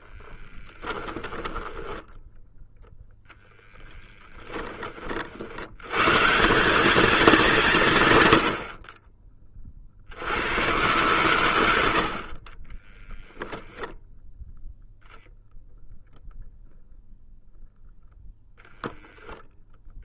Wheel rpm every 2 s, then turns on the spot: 10, 0, 30, 190, 60, 90, 10, 0, 0, 0.
0-2